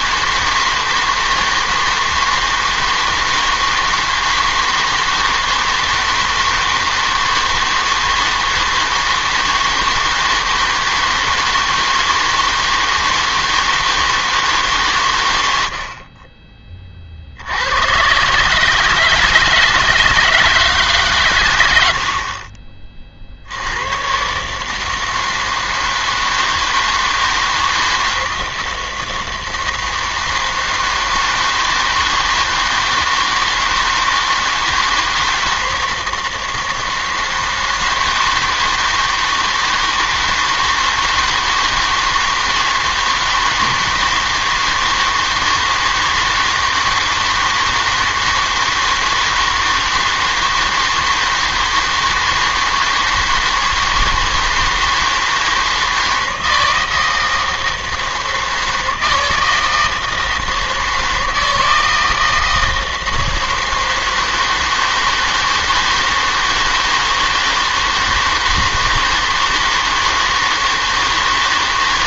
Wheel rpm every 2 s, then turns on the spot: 160, 160, 160, 160, 160, 160, 160, 150, 20, 150, 160, 40, 150, 160, 160, 160, 160, 160, 160, 160, 160, 160, 160, 160, 160, 160, 160, 160, 160, 160, 160, 160, 160, 160, 160, 160.
none